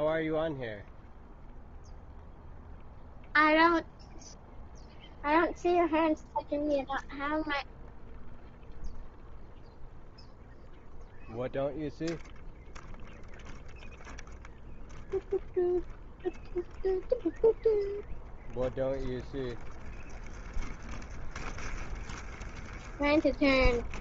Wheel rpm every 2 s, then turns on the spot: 0, 0, 0, 0, 0, 0, 0, 0, 0, 10, 20, 10.
20-24